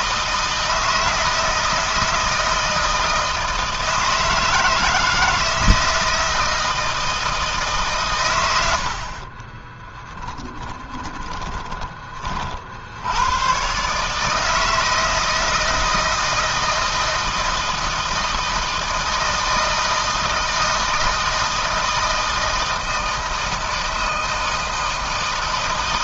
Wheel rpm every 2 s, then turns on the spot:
160, 160, 160, 160, 80, 10, 70, 160, 160, 160, 160, 160, 160.
8-12